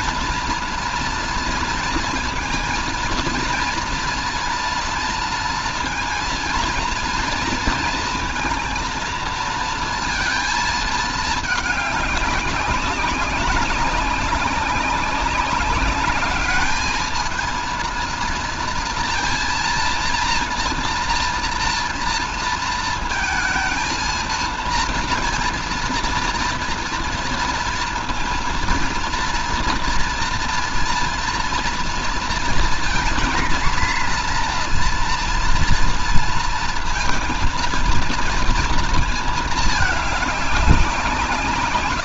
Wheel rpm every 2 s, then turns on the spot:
230, 230, 230, 230, 230, 230, 200, 200, 210, 230, 230, 230, 230, 230, 230, 230, 230, 230, 230, 230, 210.
none